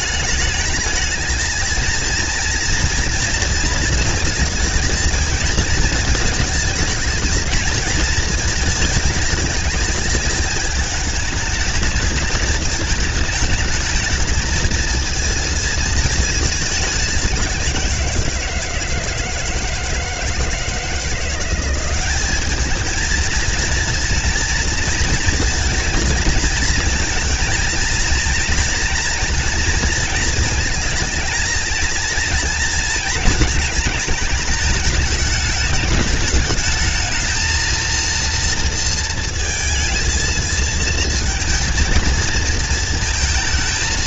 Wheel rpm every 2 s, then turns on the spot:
210, 230, 230, 220, 220, 210, 220, 220, 210, 170, 160, 210, 230, 220, 230, 230, 230, 210, 210, 230, 230, 230.
none